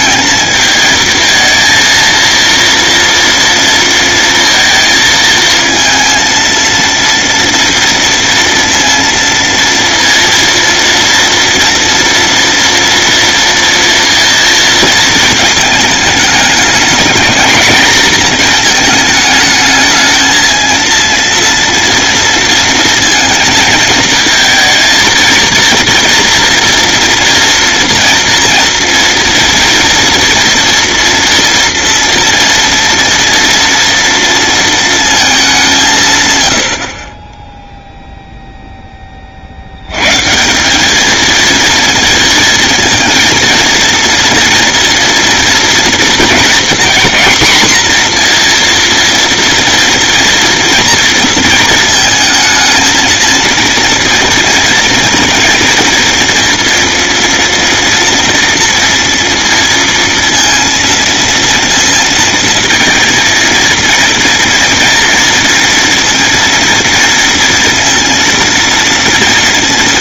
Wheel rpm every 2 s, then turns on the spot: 220, 230, 220, 230, 230, 230, 230, 220, 220, 220, 230, 230, 230, 230, 240, 230, 230, 210, 20, 30, 220, 230, 230, 230, 230, 230, 230, 230, 230, 230, 230, 230, 230, 230, 230.
none